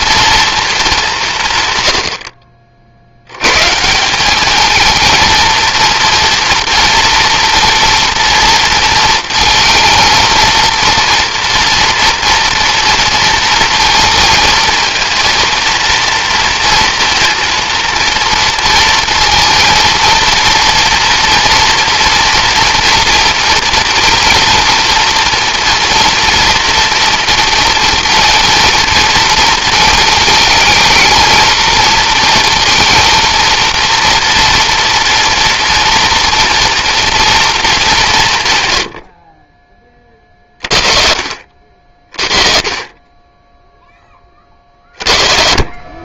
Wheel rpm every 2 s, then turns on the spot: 160, 100, 230, 240, 230, 240, 230, 230, 230, 230, 240, 230, 230, 230, 230, 220, 230, 230, 230, 40, 40, 20, 50.
none